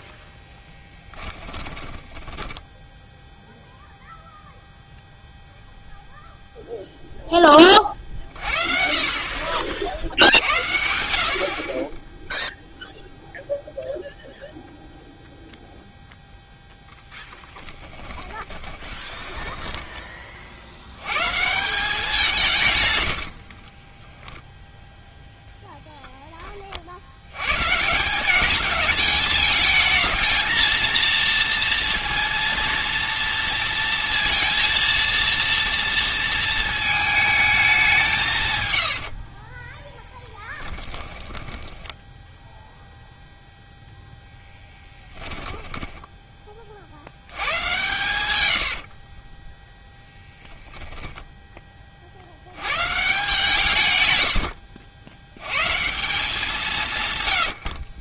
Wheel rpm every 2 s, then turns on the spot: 10, 10, 0, 0, 40, 90, 0, 0, 10, 20, 90, 110, 0, 50, 210, 230, 230, 230, 220, 100, 10, 0, 10, 60, 50, 0, 130, 80, 160.
0-2 16-20 22-24 40-42 44-46 48-50